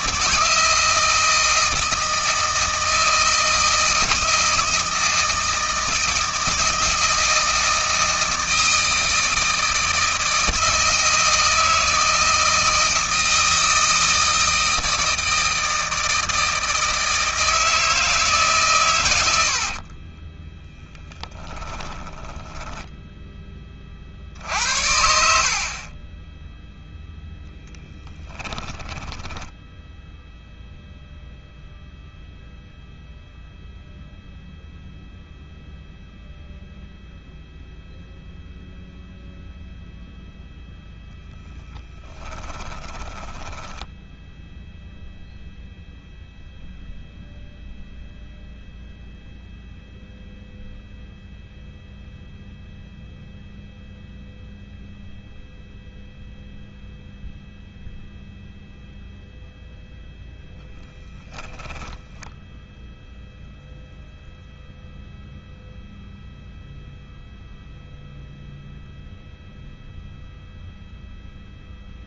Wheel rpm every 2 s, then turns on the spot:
160, 160, 160, 160, 160, 160, 160, 160, 160, 110, 10, 10, 70, 0, 10, 0, 0, 0, 0, 0, 10, 20, 0, 0, 0, 0, 0, 0, 0, 0, 10, 0, 0, 0, 0, 0.
20-24 28-30 42-44